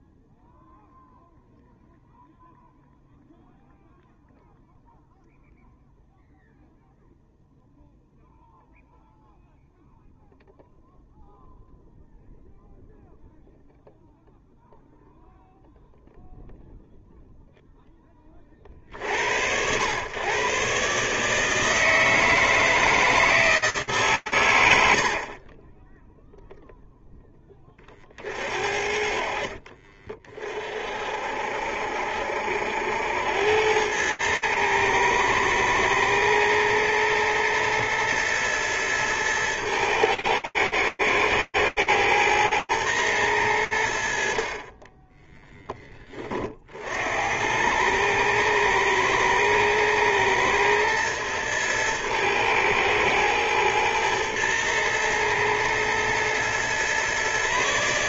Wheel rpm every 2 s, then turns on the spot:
0, 0, 0, 0, 0, 0, 0, 0, 0, 90, 150, 160, 40, 10, 50, 60, 90, 110, 110, 110, 110, 110, 20, 90, 110, 120, 110, 110, 140.
24-26